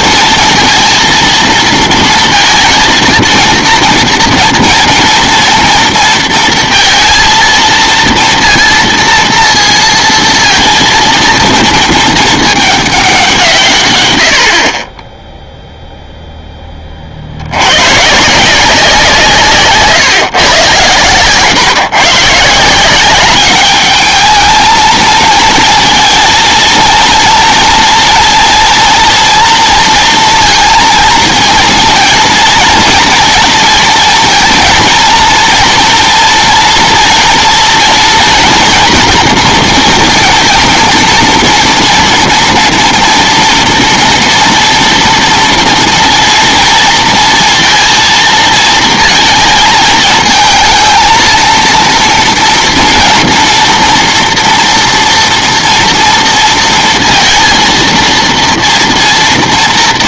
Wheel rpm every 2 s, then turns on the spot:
230, 230, 230, 230, 230, 230, 210, 30, 30, 170, 130, 180, 220, 230, 230, 230, 230, 220, 230, 230, 230, 230, 230, 230, 220, 220, 230, 230, 230, 230.
none